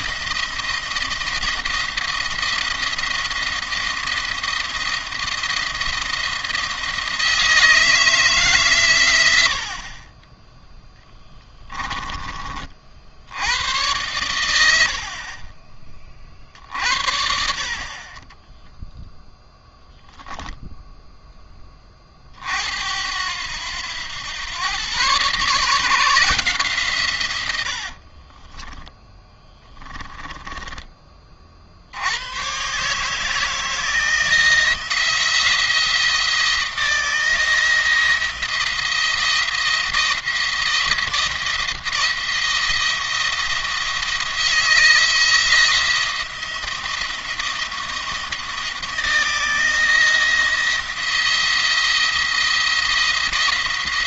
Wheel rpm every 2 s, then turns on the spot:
170, 170, 170, 170, 140, 10, 40, 80, 50, 0, 0, 60, 120, 150, 30, 20, 130, 170, 170, 170, 170, 170, 160, 170, 170, 170, 170.
28-30